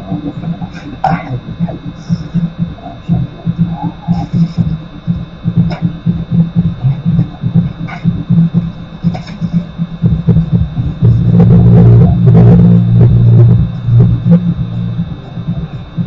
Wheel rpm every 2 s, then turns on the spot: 0, 0, 0, 0, 0, 0, 0, 0.
none